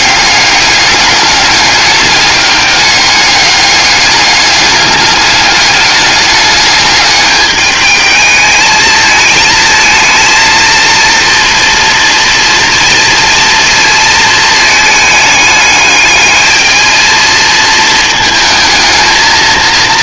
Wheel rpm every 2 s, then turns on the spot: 200, 200, 200, 210, 220, 230, 240, 220, 220, 220.
none